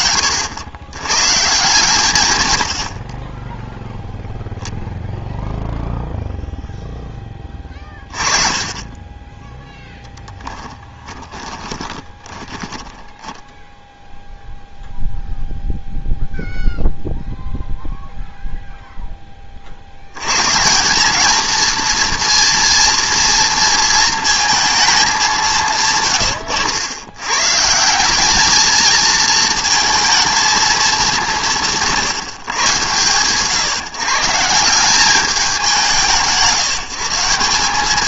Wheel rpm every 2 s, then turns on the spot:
100, 80, 0, 0, 20, 20, 10, 0, 0, 0, 170, 230, 220, 100, 220, 220, 110, 160, 160.
10-14